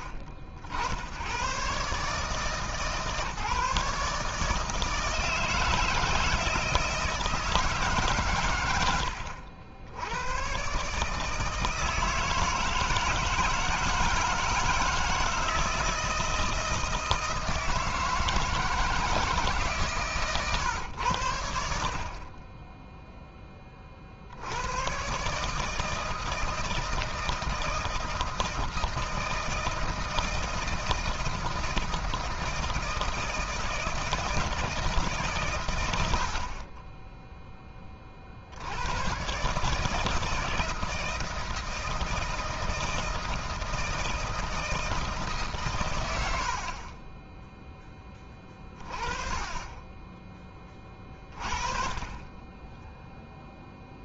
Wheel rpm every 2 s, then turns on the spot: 70, 150, 160, 160, 100, 130, 160, 160, 160, 160, 100, 0, 110, 160, 160, 160, 160, 160, 20, 100, 160, 160, 160, 20, 20, 20, 10.
8-10